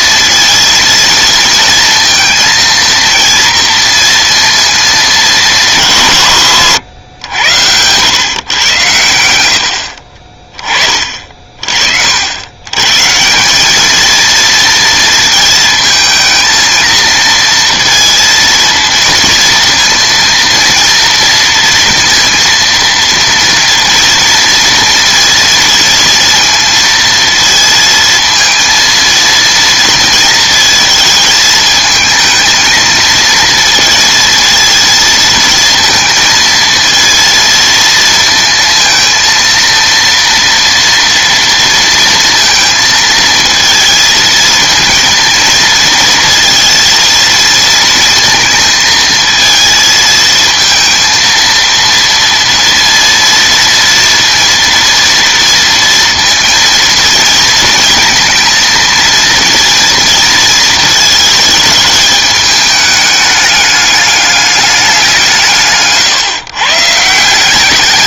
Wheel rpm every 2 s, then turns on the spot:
230, 230, 220, 120, 120, 30, 110, 230, 230, 230, 230, 230, 230, 230, 230, 230, 220, 230, 230, 230, 230, 220, 230, 230, 230, 230, 230, 230, 230, 230, 220, 210, 200, 140.
8-10